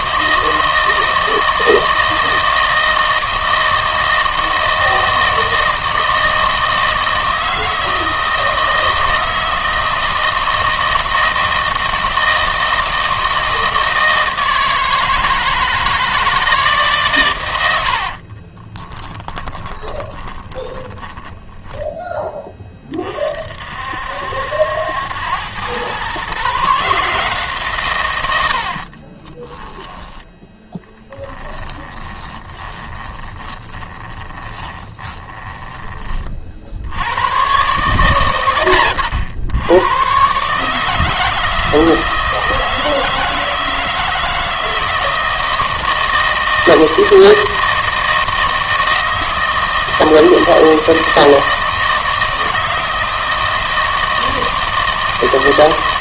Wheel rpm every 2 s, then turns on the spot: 160, 160, 160, 160, 160, 160, 160, 160, 150, 20, 20, 20, 80, 150, 70, 10, 20, 20, 60, 90, 150, 160, 160, 160, 160, 160, 160, 160.
18-22 32-36